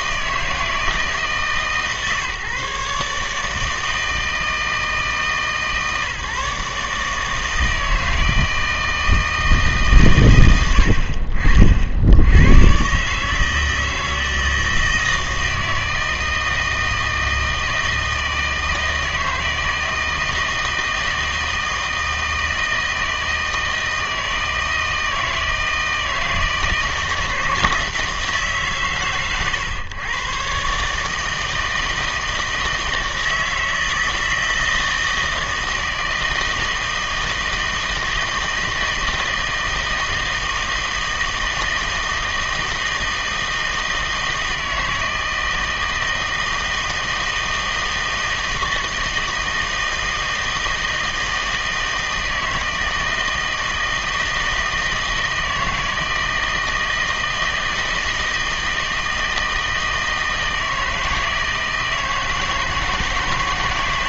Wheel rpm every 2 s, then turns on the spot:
160, 140, 160, 150, 160, 90, 100, 160, 160, 160, 160, 160, 160, 160, 140, 140, 160, 160, 160, 160, 160, 160, 160, 160, 160, 160, 160, 160, 160, 160, 160, 160.
none